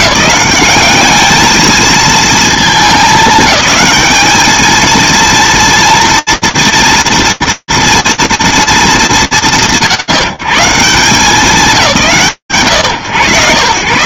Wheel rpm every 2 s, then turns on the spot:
210, 220, 210, 230, 150, 180, 110.
none